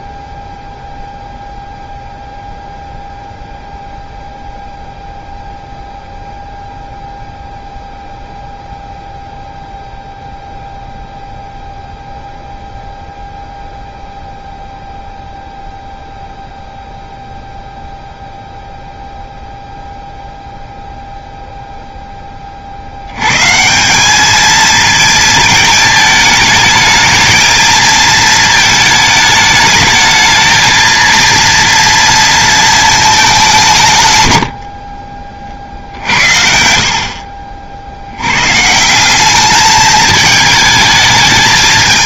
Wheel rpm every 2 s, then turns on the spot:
0, 0, 0, 0, 0, 0, 0, 0, 0, 0, 0, 70, 220, 220, 220, 230, 220, 50, 60, 160, 220.
34-36